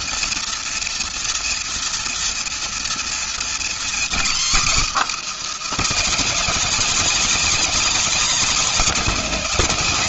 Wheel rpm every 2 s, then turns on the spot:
240, 230, 270, 300, 280.
none